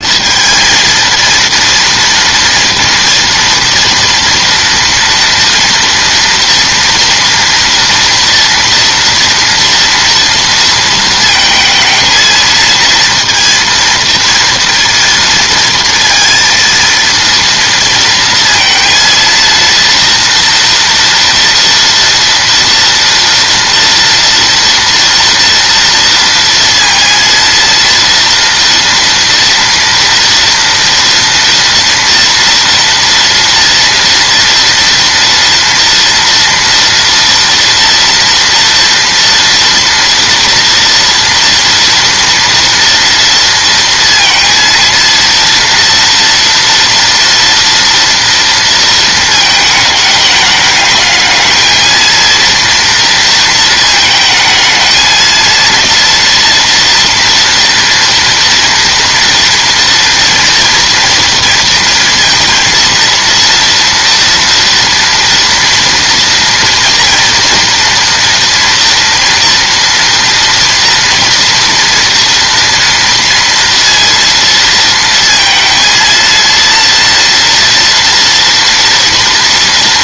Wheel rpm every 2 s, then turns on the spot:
230, 240, 230, 230, 230, 230, 230, 230, 230, 230, 230, 230, 230, 230, 230, 230, 230, 230, 230, 230, 230, 230, 230, 230, 230, 210, 230, 220, 230, 230, 230, 230, 230, 240, 230, 230, 230, 230, 230, 230.
none